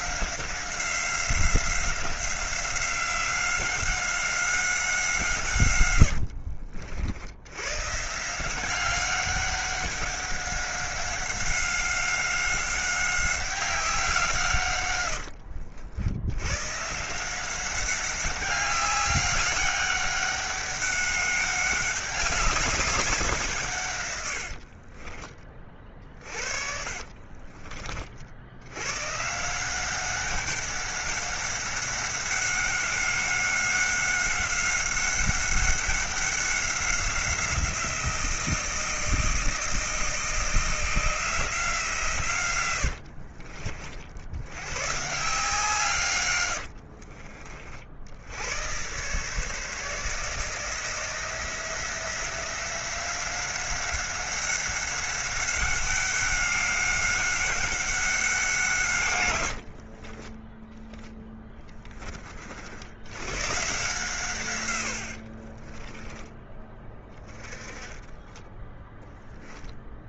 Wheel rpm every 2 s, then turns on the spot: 180, 190, 180, 70, 190, 190, 190, 110, 140, 200, 200, 190, 40, 50, 110, 190, 190, 190, 190, 160, 170, 80, 120, 50, 120, 160, 180, 190, 190, 140, 10, 70, 110, 20, 10.
24-28 42-44 46-48 58-60 64-66 68-70